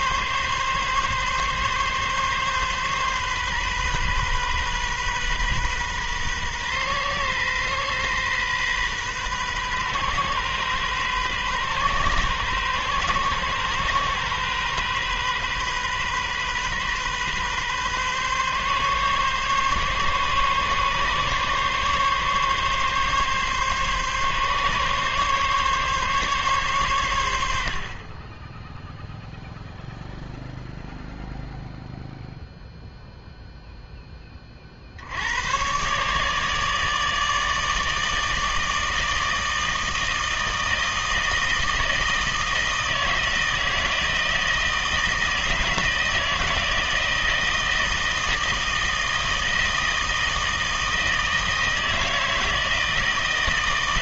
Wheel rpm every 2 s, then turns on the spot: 130, 130, 130, 130, 130, 130, 130, 130, 130, 140, 140, 140, 140, 120, 0, 0, 0, 60, 150, 160, 160, 160, 160, 160, 160, 160, 160.
none